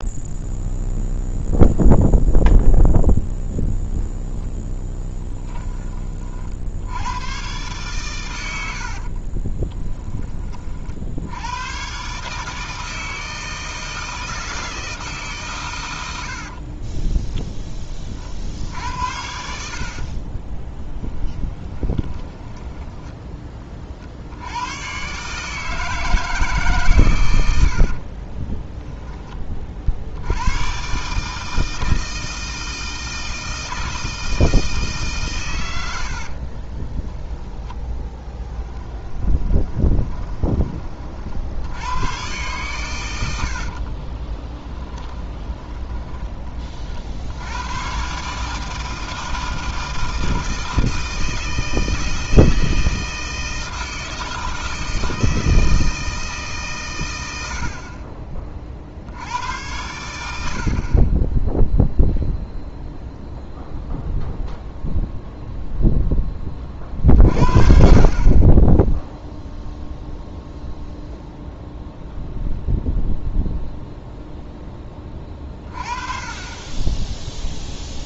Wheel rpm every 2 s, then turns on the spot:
0, 0, 10, 70, 90, 30, 160, 160, 30, 60, 20, 10, 90, 150, 10, 120, 160, 160, 30, 10, 30, 120, 10, 30, 160, 160, 160, 160, 140, 40, 60, 0, 0, 30, 20, 0, 0, 10, 20.
16-18 20-24 28-30 36-40 44-46